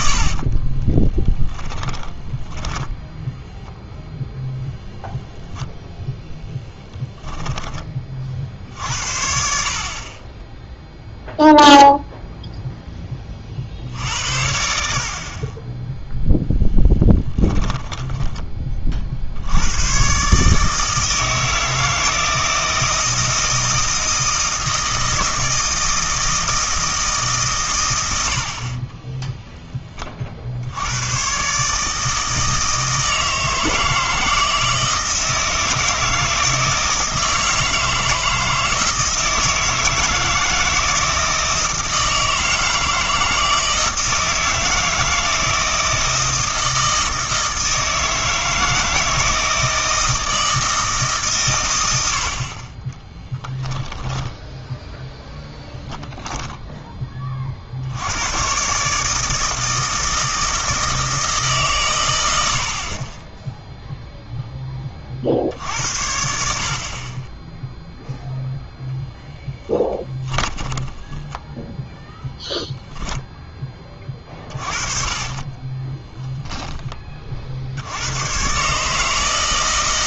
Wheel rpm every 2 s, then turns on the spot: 30, 10, 0, 10, 60, 0, 10, 60, 10, 30, 150, 160, 160, 160, 40, 70, 160, 160, 160, 160, 160, 160, 160, 160, 160, 160, 30, 0, 10, 140, 160, 60, 20, 50, 0, 20, 0, 40, 10, 140.
0-4 6-8 70-72 74-76